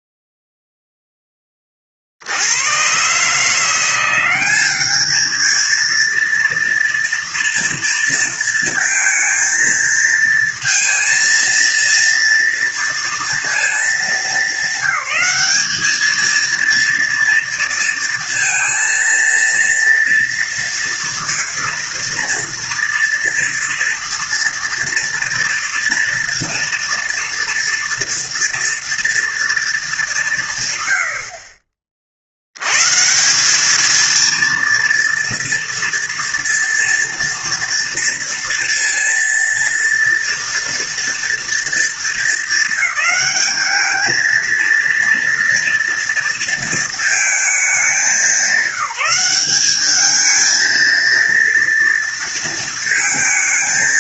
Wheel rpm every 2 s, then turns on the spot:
0, 90, 200, 230, 230, 230, 230, 190, 230, 230, 230, 230, 230, 230, 230, 160, 90, 230, 230, 230, 230, 220, 230, 230, 190, 220, 230.
none